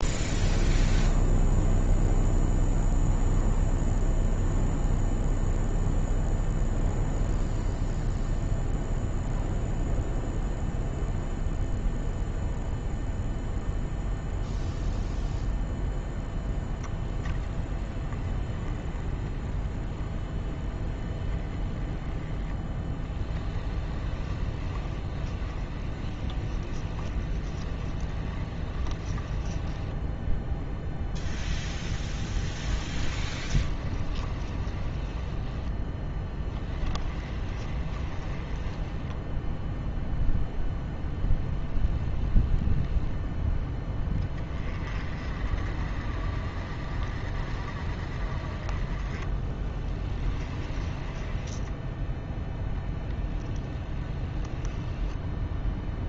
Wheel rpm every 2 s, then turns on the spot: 0, 0, 0, 0, 0, 0, 0, 0, 0, 20, 20, 10, 20, 20, 20, 0, 20, 20, 10, 10, 0, 0, 30, 40, 20, 20, 10, 10.
22-30 32-40 50-52